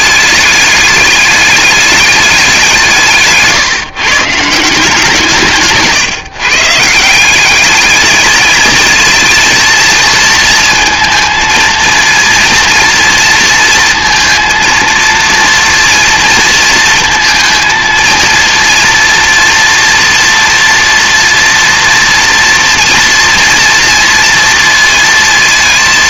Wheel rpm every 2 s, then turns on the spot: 210, 200, 150, 150, 220, 230, 230, 230, 230, 230, 240, 230, 230.
none